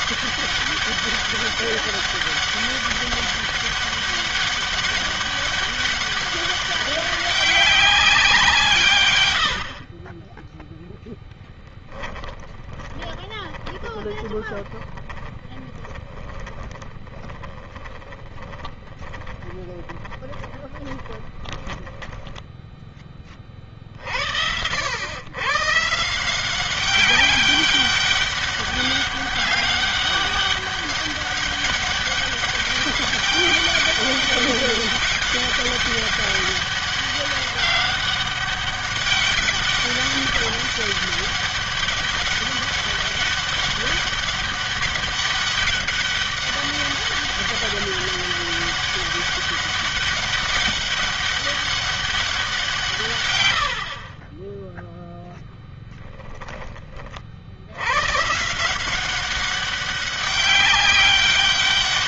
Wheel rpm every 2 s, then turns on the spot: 200, 200, 200, 200, 160, 10, 20, 30, 30, 20, 20, 10, 80, 190, 200, 200, 200, 200, 200, 200, 200, 200, 200, 200, 200, 200, 160, 10, 20, 170, 200.
12-22 54-56